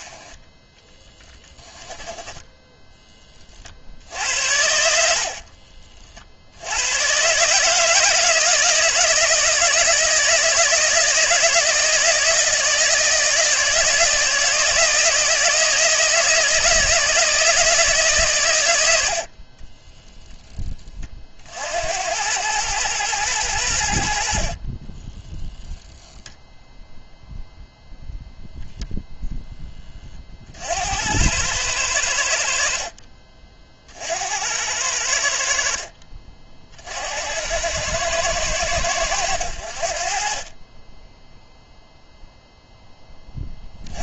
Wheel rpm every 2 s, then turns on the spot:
10, 10, 60, 110, 160, 160, 160, 160, 160, 80, 30, 110, 20, 0, 0, 90, 50, 80, 60, 100, 10, 10.
0-2 4-6 24-26 40-42